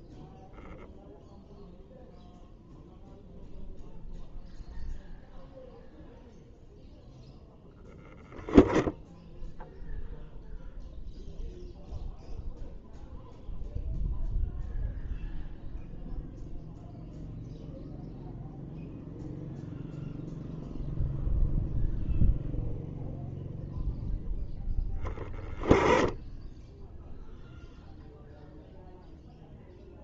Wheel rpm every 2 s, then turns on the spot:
0, 0, 0, 0, 0, 0, 0, 0, 0, 0, 0, 0, 10, 0, 0.
none